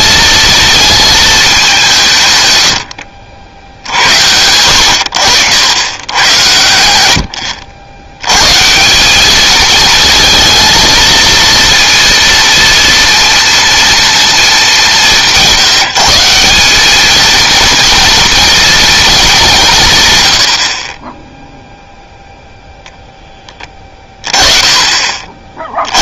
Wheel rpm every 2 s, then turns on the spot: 220, 90, 90, 90, 140, 230, 230, 200, 200, 230, 60, 0, 20.
none